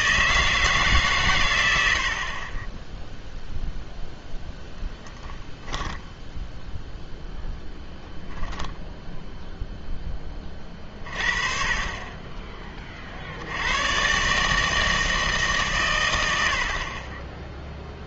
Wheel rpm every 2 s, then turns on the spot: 160, 20, 0, 0, 0, 30, 20, 160, 40.
16-18